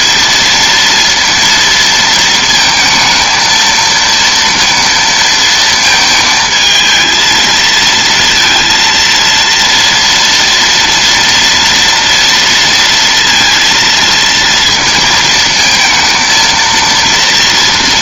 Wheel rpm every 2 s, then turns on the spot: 230, 220, 230, 220, 230, 230, 230, 230, 230.
none